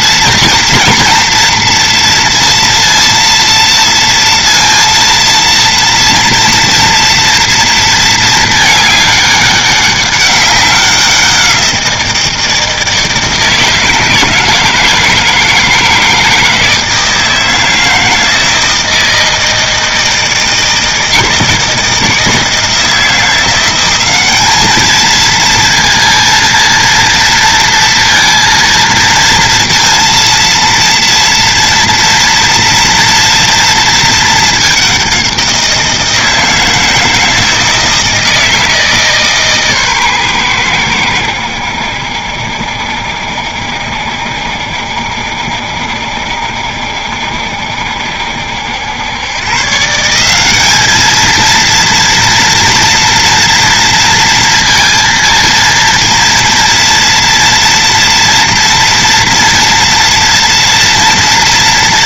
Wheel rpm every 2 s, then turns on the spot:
230, 230, 230, 230, 220, 190, 170, 170, 160, 160, 160, 160, 210, 230, 230, 230, 230, 210, 160, 160, 100, 70, 70, 60, 80, 200, 230, 230, 230, 230, 230.
none